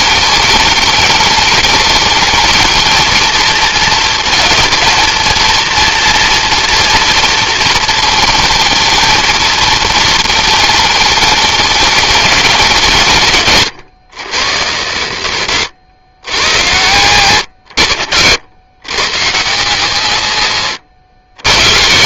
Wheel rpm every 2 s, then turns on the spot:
210, 220, 230, 230, 220, 220, 190, 110, 100, 90, 120.
none